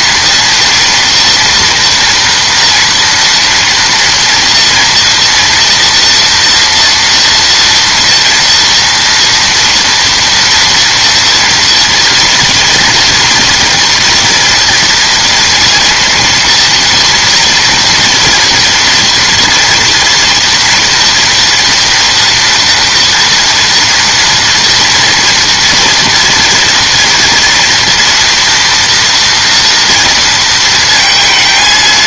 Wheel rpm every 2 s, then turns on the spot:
230, 230, 230, 230, 230, 230, 240, 240, 230, 240, 240, 240, 230, 230, 240, 230.
none